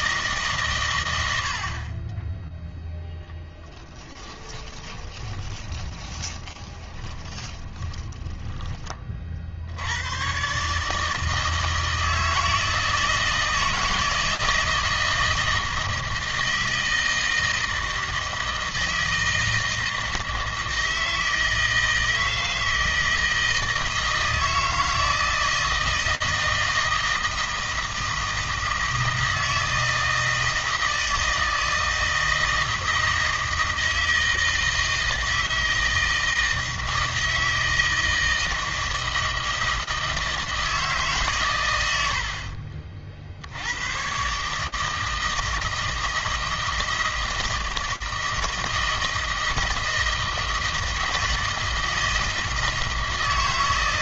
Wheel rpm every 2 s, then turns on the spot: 120, 0, 20, 20, 20, 150, 160, 160, 160, 160, 160, 160, 160, 160, 160, 160, 160, 160, 160, 160, 160, 50, 150, 160, 160, 160, 160.
4-8 42-44